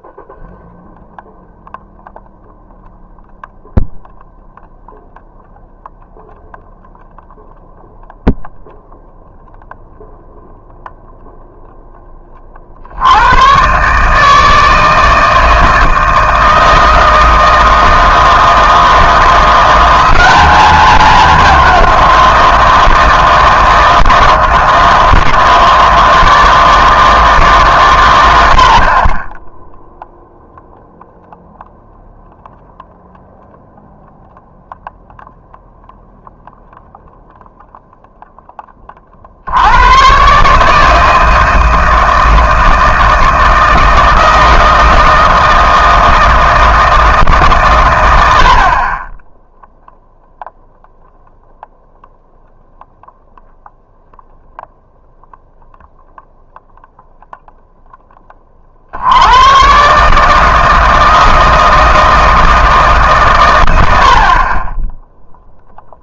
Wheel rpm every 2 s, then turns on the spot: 0, 0, 0, 0, 0, 0, 50, 160, 160, 160, 210, 170, 160, 160, 60, 0, 0, 0, 0, 10, 150, 160, 160, 160, 50, 0, 0, 0, 0, 50, 160, 160, 30.
none